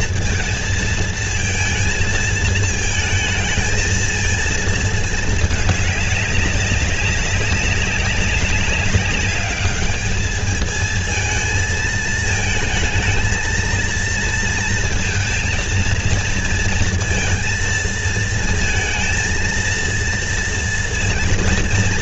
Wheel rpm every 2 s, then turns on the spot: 230, 220, 230, 200, 200, 210, 220, 230, 230, 230, 230.
none